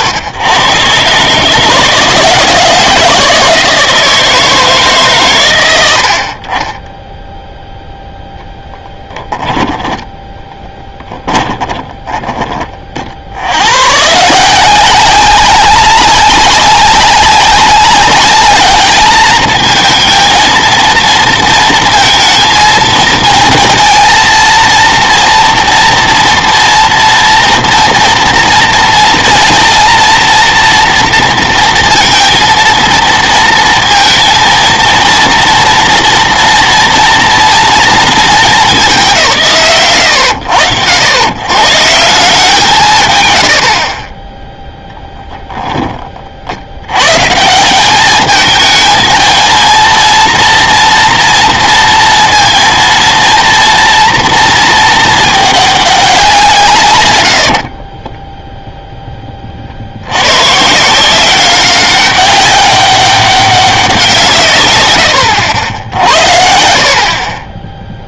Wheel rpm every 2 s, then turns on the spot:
130, 160, 160, 30, 10, 10, 20, 170, 200, 210, 230, 230, 230, 230, 230, 240, 230, 230, 230, 230, 90, 180, 10, 50, 220, 230, 230, 230, 190, 0, 120, 200, 150, 50.
10-12 44-46